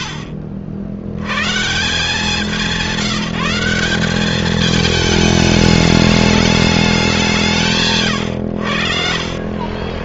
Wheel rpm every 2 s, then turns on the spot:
80, 190, 210, 170, 50.
8-10